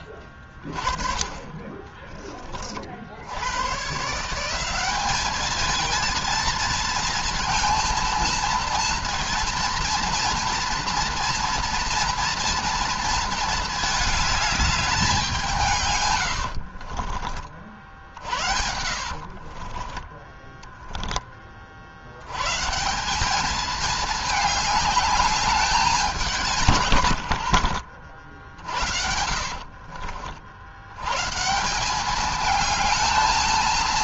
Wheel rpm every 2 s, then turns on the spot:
20, 40, 180, 230, 230, 230, 230, 210, 60, 80, 10, 140, 220, 160, 70, 70, 210.
16-22 26-30